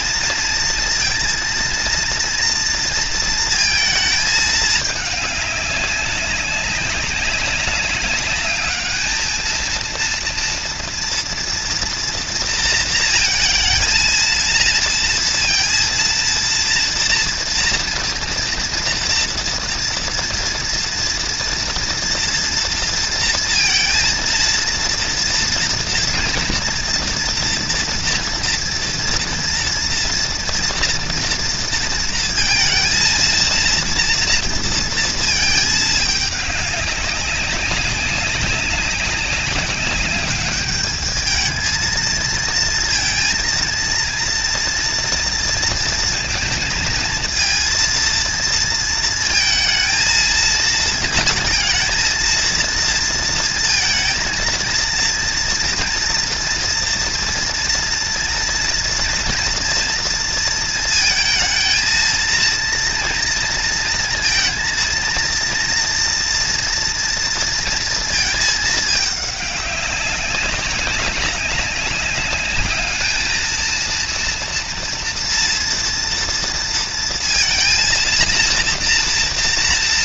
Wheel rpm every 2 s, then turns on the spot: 230, 230, 210, 190, 220, 230, 230, 230, 230, 230, 230, 230, 230, 240, 230, 230, 230, 230, 200, 200, 210, 230, 230, 230, 230, 230, 230, 230, 230, 240, 230, 230, 230, 230, 210, 190, 210, 240, 230, 240.
none